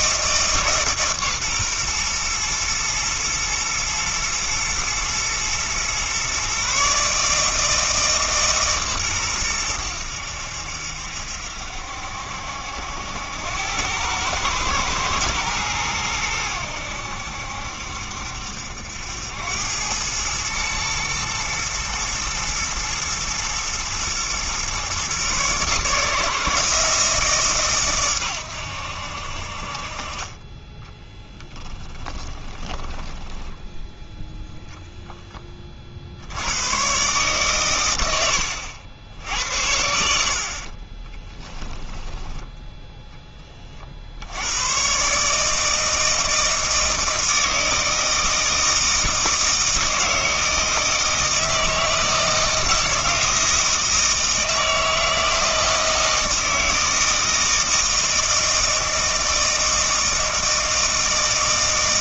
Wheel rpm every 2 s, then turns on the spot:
150, 120, 110, 140, 140, 70, 70, 110, 90, 70, 110, 120, 130, 160, 90, 20, 10, 0, 110, 80, 30, 0, 110, 160, 160, 160, 170, 160, 160, 160, 160.
32-34 40-42